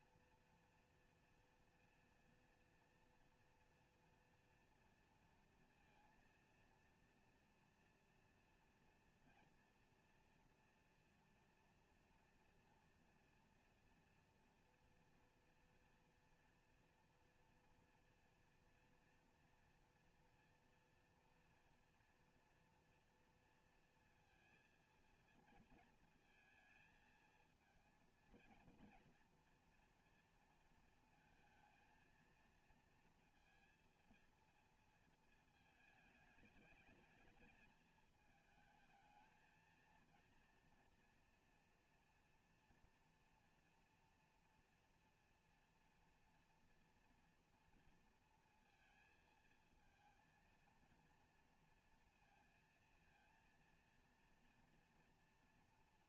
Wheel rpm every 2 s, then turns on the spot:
230, 230, 230, 230, 230, 230, 230, 230, 230, 230, 230, 230, 230, 220, 230, 230, 230, 230, 210, 220, 230, 230, 230, 230, 230, 230, 230, 230.
none